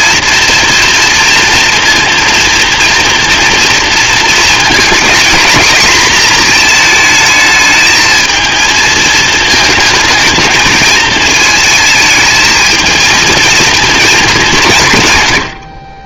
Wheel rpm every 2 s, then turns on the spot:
240, 240, 230, 230, 220, 220, 220, 170.
none